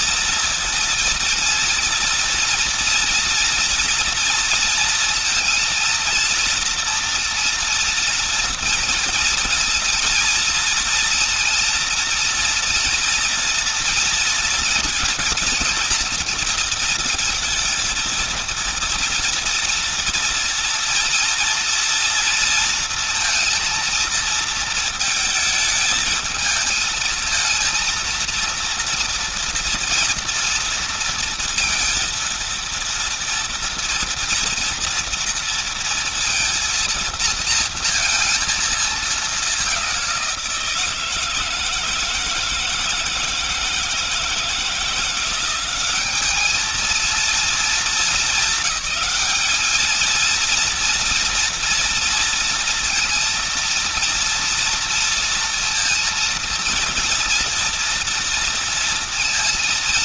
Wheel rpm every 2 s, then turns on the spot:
230, 230, 230, 230, 230, 230, 230, 230, 230, 230, 230, 230, 230, 220, 230, 230, 230, 230, 230, 220, 170, 160, 170, 210, 210, 230, 230, 230, 230, 230.
none